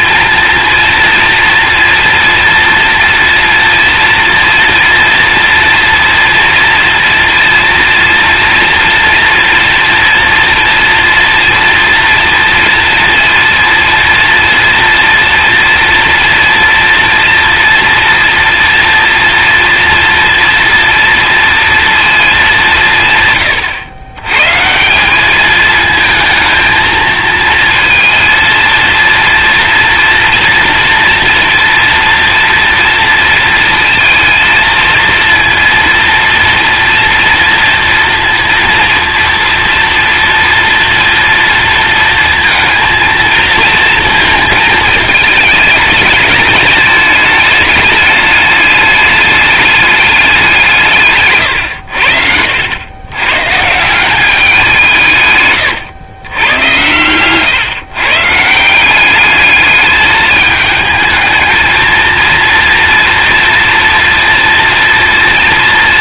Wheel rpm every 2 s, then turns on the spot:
230, 230, 230, 230, 230, 230, 230, 240, 240, 230, 230, 180, 170, 220, 230, 230, 230, 230, 230, 230, 230, 230, 220, 210, 210, 160, 100, 190, 120, 170, 220, 230, 240.
none